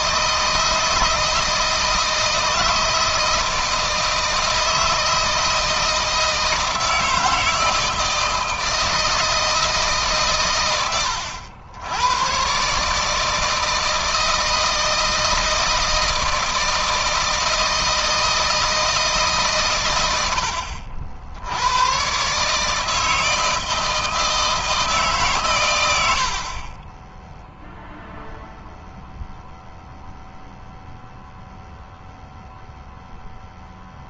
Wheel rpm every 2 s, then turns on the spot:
160, 160, 160, 160, 160, 110, 130, 160, 160, 160, 80, 150, 160, 40, 0, 0, 0.
none